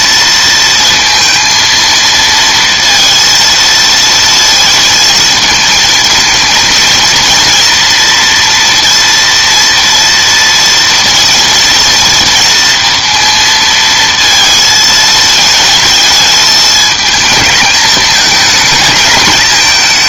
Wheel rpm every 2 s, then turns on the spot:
230, 230, 230, 230, 230, 230, 230, 220, 220, 210.
none